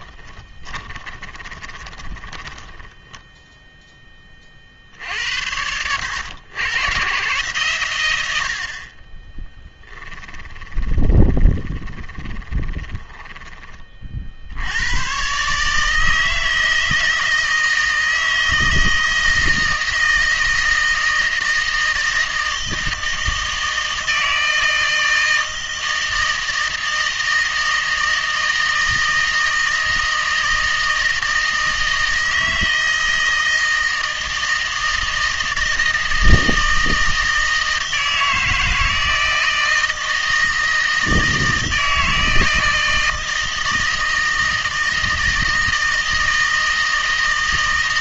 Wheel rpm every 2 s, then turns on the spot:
20, 10, 50, 100, 60, 20, 20, 80, 160, 160, 160, 160, 160, 160, 160, 160, 160, 160, 160, 160, 160, 160, 160, 160.
0-4 10-14